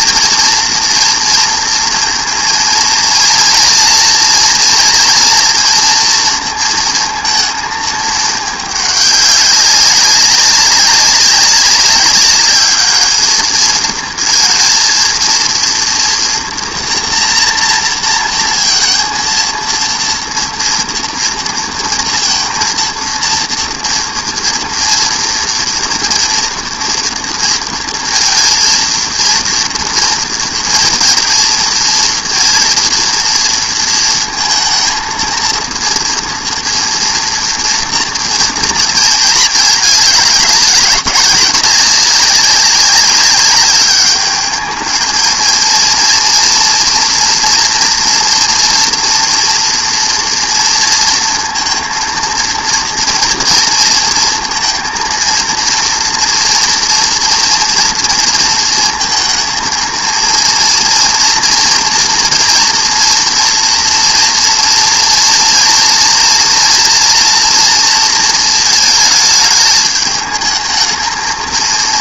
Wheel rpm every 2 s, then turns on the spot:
230, 230, 230, 230, 210, 200, 210, 230, 240, 230, 230, 230, 230, 240, 230, 230, 230, 220, 240, 230, 200, 200, 210, 230, 230, 230, 230, 230, 230, 230, 230, 230, 230, 230, 220, 220.
none